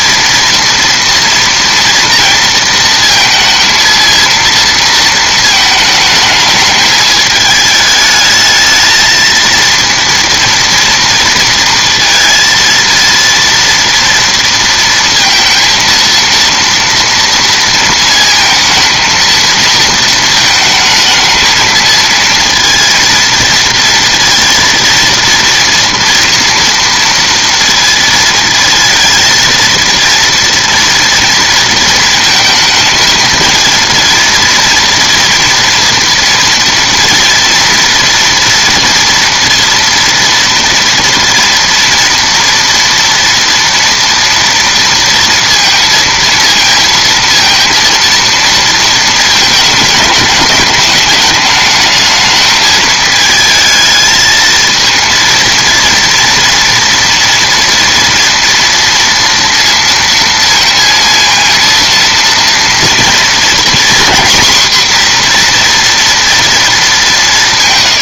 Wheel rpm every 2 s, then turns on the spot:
230, 230, 230, 210, 220, 230, 230, 230, 230, 220, 220, 230, 230, 230, 230, 230, 220, 230, 230, 230, 230, 230, 230, 230, 230, 210, 220, 220, 230, 230, 230, 230, 250, 230.
none